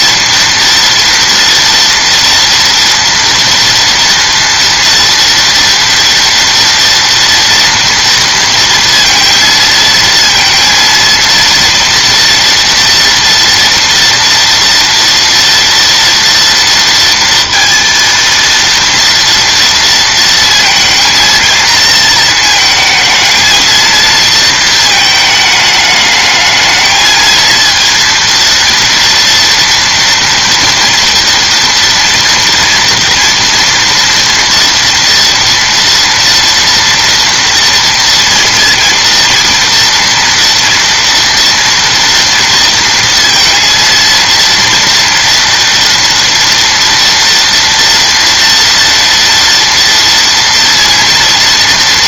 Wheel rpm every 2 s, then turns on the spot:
230, 230, 230, 230, 230, 230, 230, 230, 230, 230, 230, 220, 220, 220, 230, 240, 240, 230, 230, 230, 230, 230, 230, 230, 230, 230.
none